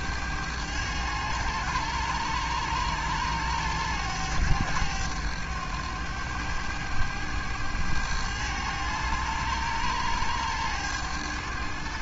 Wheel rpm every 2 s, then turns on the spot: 100, 100, 100, 100, 100, 100.
none